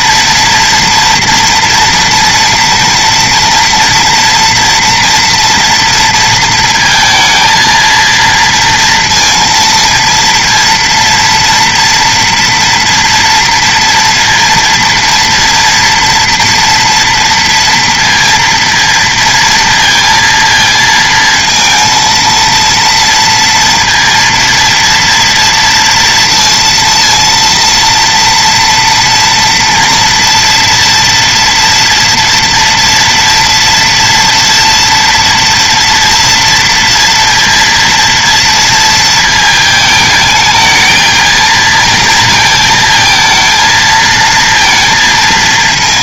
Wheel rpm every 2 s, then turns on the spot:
230, 230, 240, 230, 230, 230, 230, 230, 230, 230, 230, 230, 230, 230, 230, 240, 230, 230, 230, 230, 220, 220, 230.
none